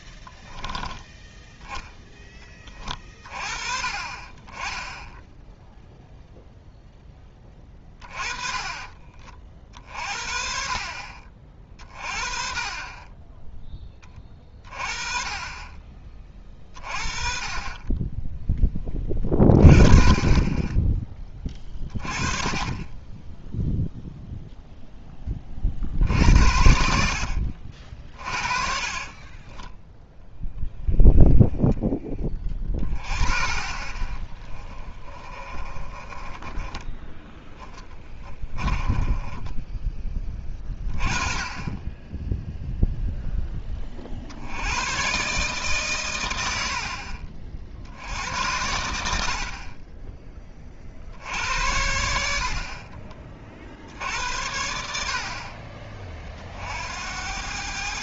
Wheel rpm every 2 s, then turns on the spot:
20, 20, 10, 0, 30, 40, 30, 30, 30, 10, 20, 30, 0, 70, 30, 0, 20, 30, 20, 20, 30, 0, 90, 70, 90, 30, 50, 80, 60.
0-2 28-30 32-40